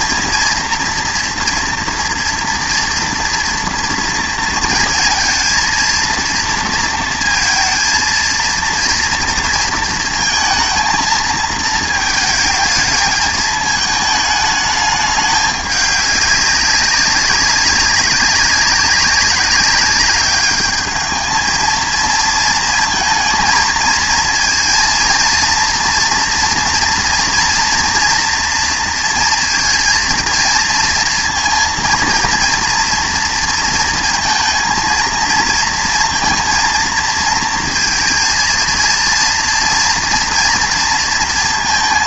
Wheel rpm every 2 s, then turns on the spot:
230, 240, 230, 230, 230, 230, 220, 210, 200, 190, 210, 230, 230, 230, 230, 230, 230, 230, 230, 230, 230.
none